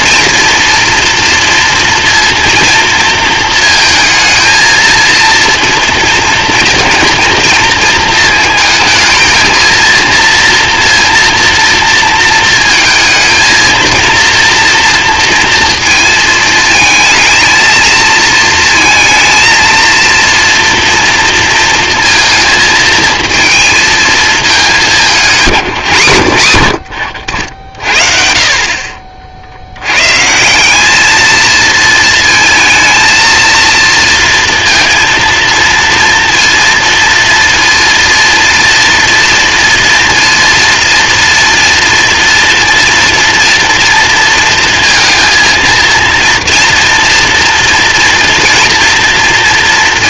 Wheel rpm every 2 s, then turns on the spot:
230, 230, 230, 230, 220, 230, 220, 230, 220, 230, 230, 230, 200, 90, 50, 200, 230, 230, 230, 230, 230, 230, 230, 230, 230.
none